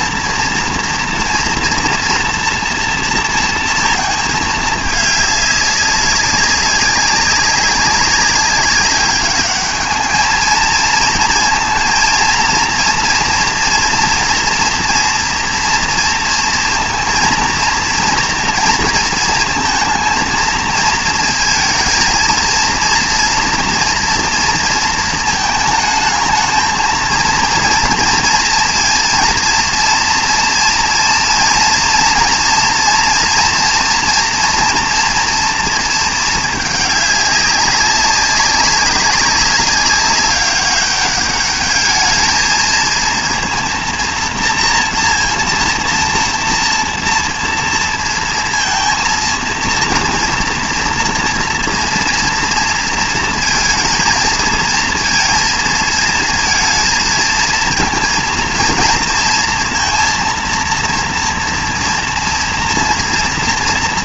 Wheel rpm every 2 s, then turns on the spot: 230, 230, 220, 200, 200, 220, 230, 230, 230, 230, 220, 220, 230, 220, 230, 230, 230, 230, 220, 200, 200, 220, 230, 230, 230, 230, 230, 230, 230, 230, 230, 240.
none